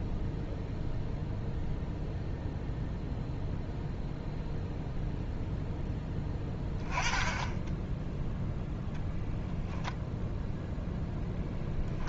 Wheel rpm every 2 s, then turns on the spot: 0, 0, 0, 10, 0, 0.
none